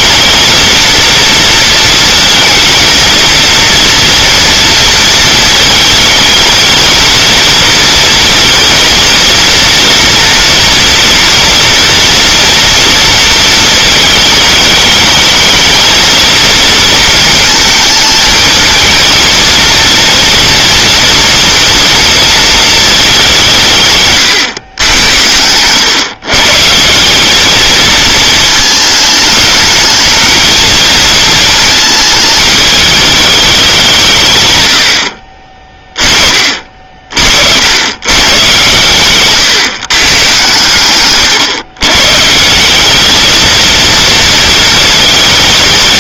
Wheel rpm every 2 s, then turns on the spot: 230, 230, 230, 220, 230, 240, 230, 220, 230, 220, 230, 210, 100, 180, 210, 220, 210, 100, 50, 120, 130, 200, 220.
none